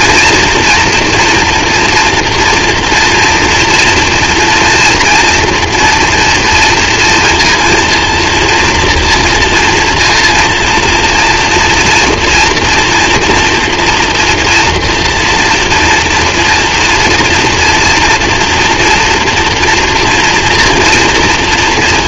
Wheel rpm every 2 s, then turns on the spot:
230, 230, 240, 230, 230, 230, 240, 230, 240, 230, 230.
none